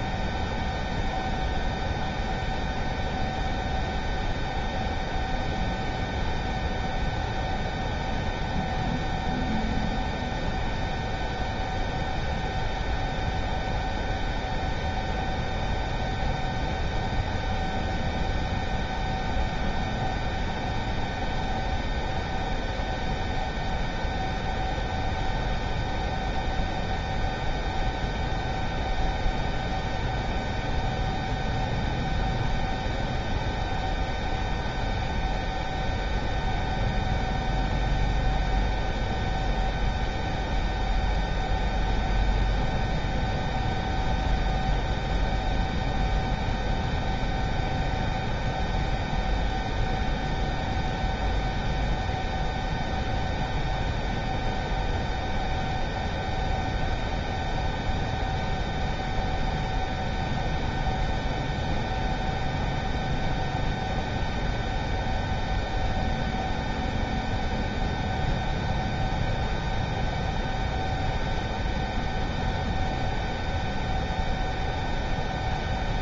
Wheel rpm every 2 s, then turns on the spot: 0, 0, 0, 0, 0, 0, 0, 0, 0, 0, 0, 0, 0, 0, 0, 0, 0, 0, 0, 0, 0, 0, 0, 0, 0, 0, 0, 0, 0, 0, 0, 0, 0, 0, 0, 0, 0, 0.
none